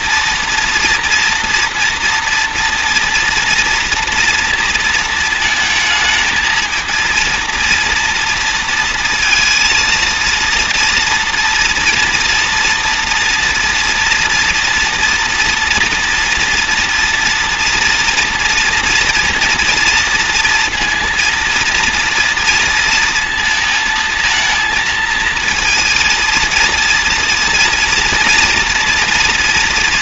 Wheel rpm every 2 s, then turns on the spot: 240, 230, 230, 230, 230, 240, 240, 230, 230, 240, 230, 230, 220, 240, 230.
none